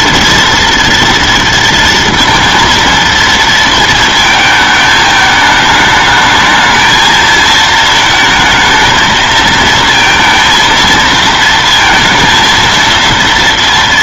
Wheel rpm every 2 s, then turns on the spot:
240, 230, 220, 220, 220, 230, 230.
none